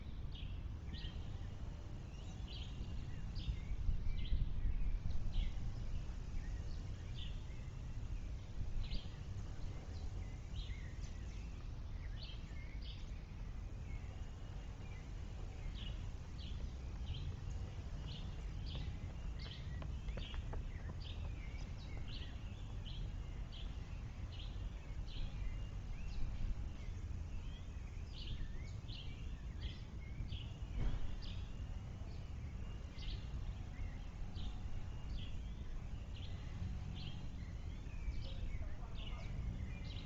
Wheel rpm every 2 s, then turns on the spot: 0, 0, 0, 0, 0, 0, 0, 0, 0, 0, 0, 0, 0, 0, 0, 0, 0, 0, 0, 0.
none